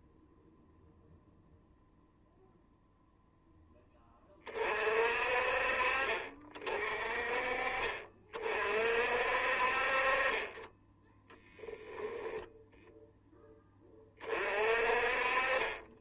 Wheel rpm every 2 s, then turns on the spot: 0, 0, 40, 40, 40, 10, 10, 40.
none